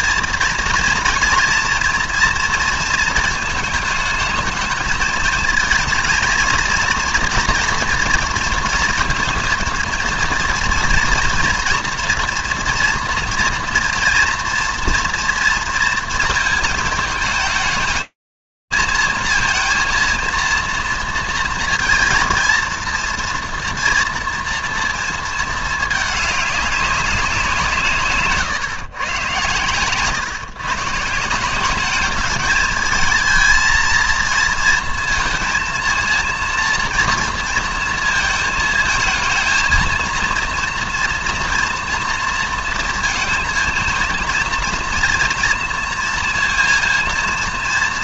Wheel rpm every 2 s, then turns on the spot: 230, 230, 220, 220, 230, 230, 240, 240, 220, 230, 230, 230, 230, 180, 120, 170, 220, 230, 230, 230, 240, 230, 230, 230.
none